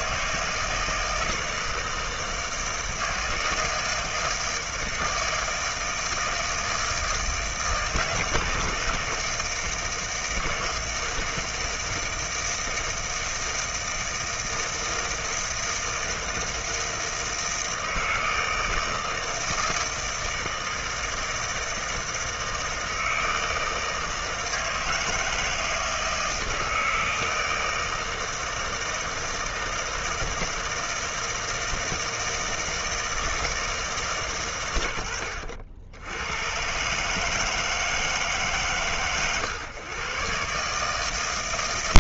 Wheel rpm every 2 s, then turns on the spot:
160, 160, 160, 160, 160, 160, 160, 160, 160, 160, 160, 160, 160, 160, 160, 160, 160, 130, 110, 130, 150.
none